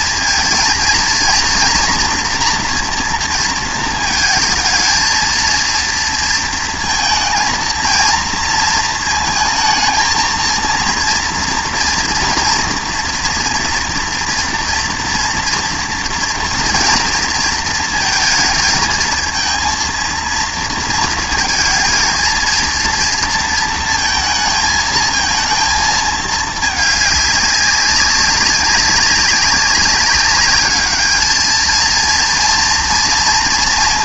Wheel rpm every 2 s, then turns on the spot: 230, 240, 220, 230, 220, 230, 230, 230, 230, 230, 230, 230, 220, 210, 190, 200, 230.
none